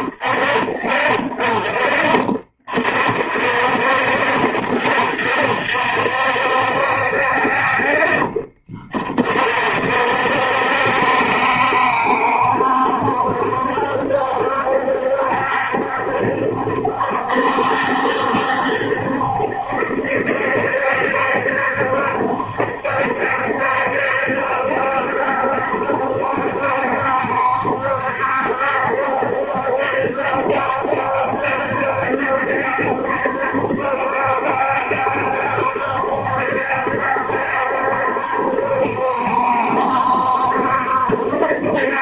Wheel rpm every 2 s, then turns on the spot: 30, 40, 30, 60, 20, 60, 70, 70, 70, 70, 70, 70, 70, 70, 70, 70, 70, 70, 70, 70, 70.
none